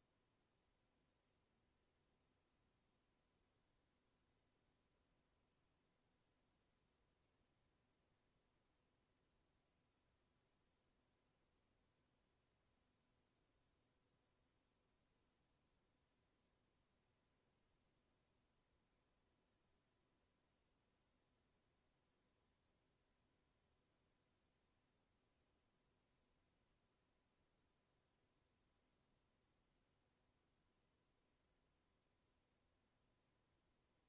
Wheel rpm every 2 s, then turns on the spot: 0, 0, 0, 0, 0, 0, 0, 0, 0, 0, 0, 0, 0, 0, 0, 0, 0.
none